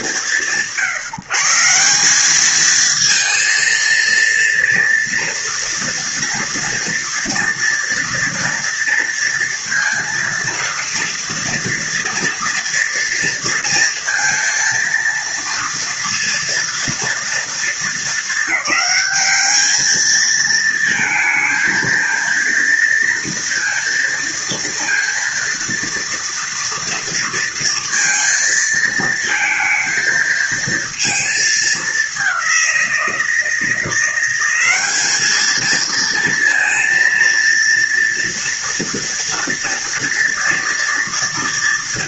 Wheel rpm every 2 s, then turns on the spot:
140, 220, 230, 230, 230, 230, 230, 230, 230, 210, 220, 230, 230, 230, 230, 230, 180, 200, 230, 230, 230.
none